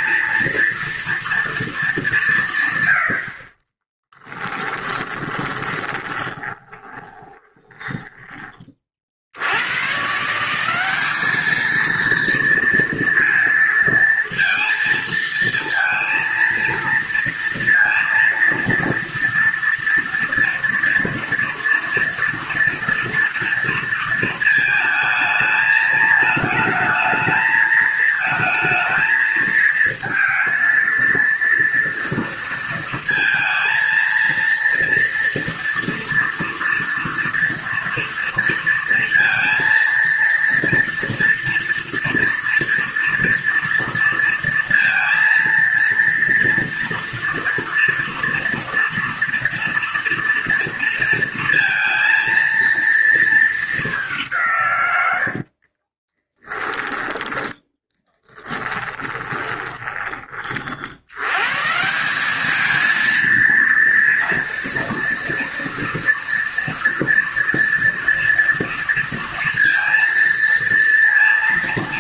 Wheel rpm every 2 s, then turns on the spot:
240, 110, 10, 20, 30, 190, 230, 230, 230, 230, 240, 230, 220, 220, 220, 230, 230, 230, 230, 230, 230, 230, 230, 230, 230, 230, 230, 130, 10, 10, 60, 220, 230, 240, 230, 230.
4-8 56-60